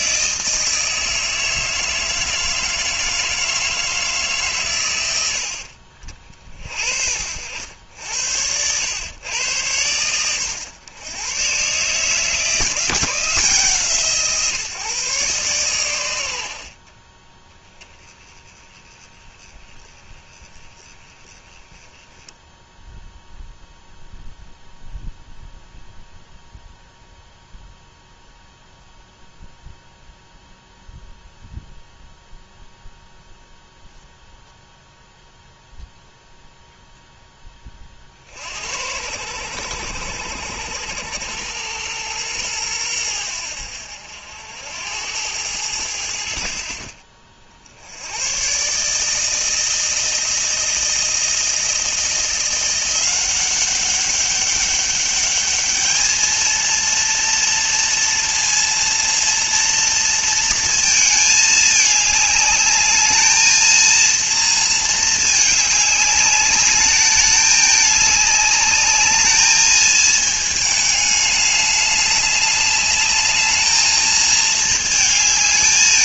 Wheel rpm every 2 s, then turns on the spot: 160, 160, 130, 50, 90, 110, 160, 150, 70, 20, 20, 0, 0, 0, 0, 0, 0, 0, 0, 70, 90, 110, 80, 50, 130, 160, 170, 200, 230, 230, 230, 210, 220, 200, 210, 220, 210, 220.
16-18